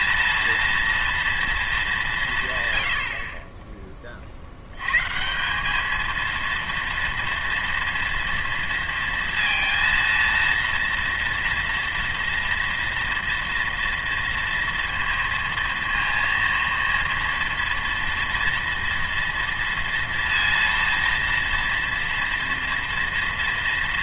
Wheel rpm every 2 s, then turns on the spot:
230, 110, 80, 230, 230, 230, 230, 230, 230, 230, 230, 230.
none